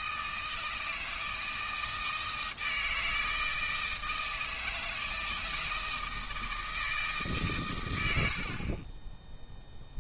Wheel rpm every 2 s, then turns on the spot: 160, 160, 160, 160, 40.
none